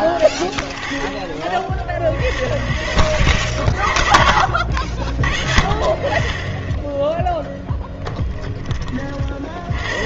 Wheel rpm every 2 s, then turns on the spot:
20, 40, 60, 30, 20.
none